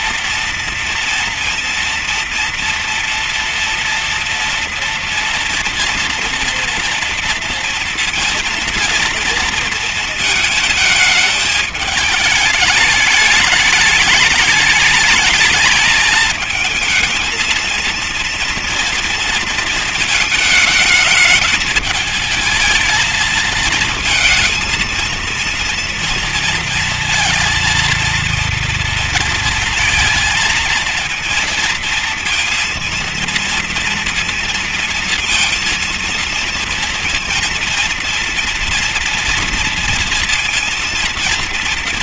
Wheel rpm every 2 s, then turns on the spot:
230, 230, 240, 230, 230, 220, 210, 210, 230, 230, 210, 220, 220, 230, 230, 230, 230, 230, 230, 230, 230.
none